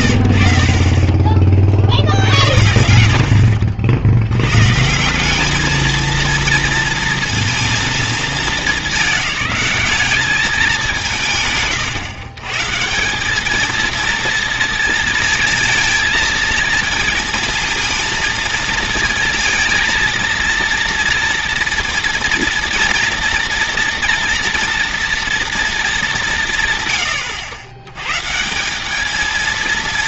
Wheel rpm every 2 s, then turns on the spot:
30, 80, 140, 230, 200, 200, 150, 230, 230, 230, 230, 230, 230, 130, 190.
0-2